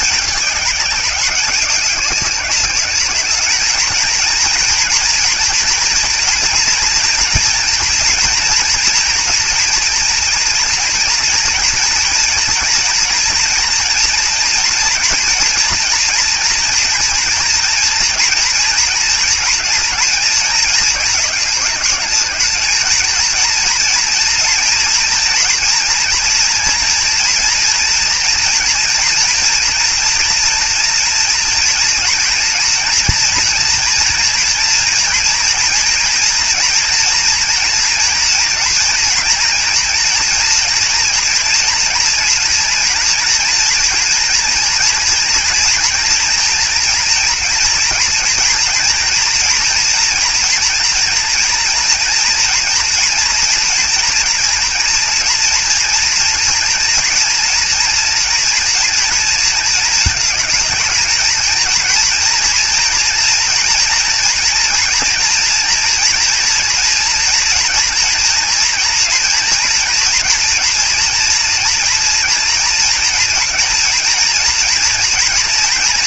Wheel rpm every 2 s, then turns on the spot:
200, 210, 230, 230, 230, 230, 240, 230, 230, 230, 220, 220, 230, 230, 240, 230, 230, 230, 230, 230, 230, 230, 230, 230, 230, 230, 240, 230, 230, 230, 220, 230, 240, 230, 230, 230, 230, 240.
none